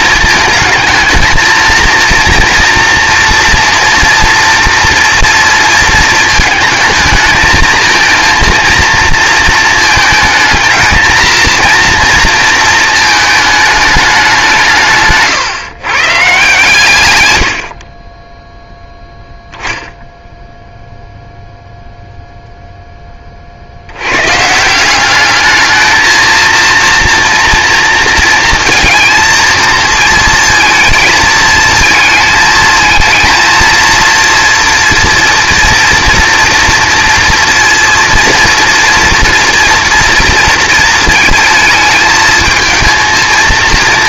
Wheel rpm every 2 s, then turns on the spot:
220, 230, 230, 220, 230, 220, 220, 160, 140, 0, 0, 10, 180, 230, 230, 220, 220, 230, 230, 230, 230, 220.
none